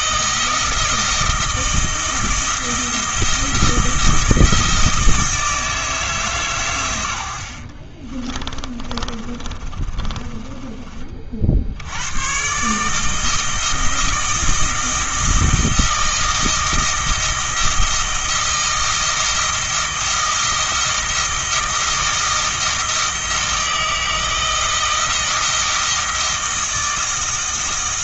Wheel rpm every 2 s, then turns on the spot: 160, 160, 160, 120, 30, 30, 150, 160, 160, 160, 160, 160, 160, 160.
8-12